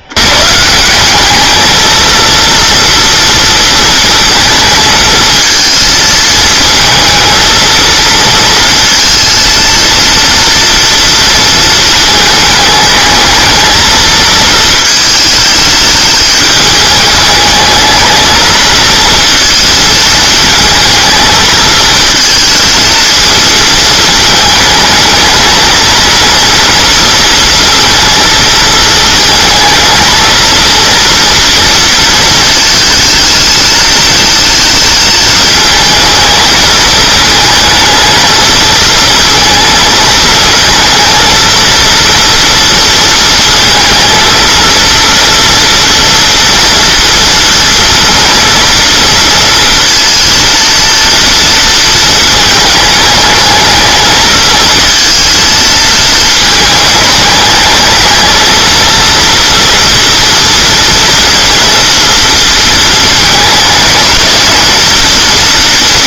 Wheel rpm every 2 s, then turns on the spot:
160, 230, 230, 220, 230, 230, 220, 220, 210, 220, 220, 230, 220, 230, 220, 230, 220, 220, 220, 230, 230, 230, 230, 230, 230, 230, 220, 230, 220, 230, 230, 220, 210.
none